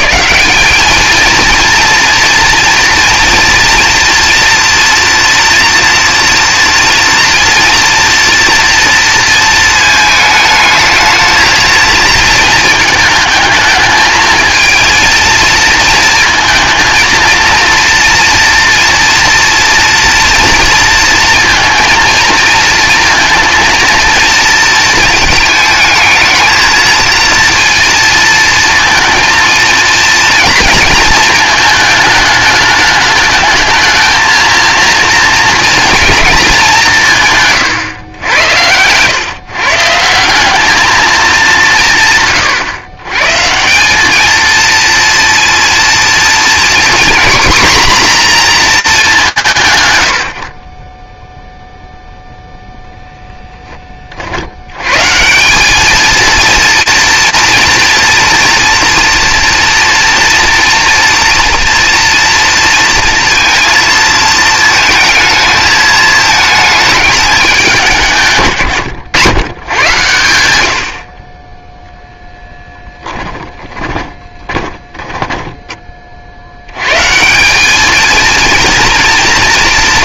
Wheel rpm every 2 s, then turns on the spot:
200, 230, 230, 240, 240, 220, 220, 220, 230, 230, 230, 230, 220, 220, 230, 230, 210, 230, 200, 90, 200, 120, 230, 230, 210, 40, 0, 80, 230, 230, 230, 230, 230, 220, 110, 80, 20, 10, 120, 230.
72-76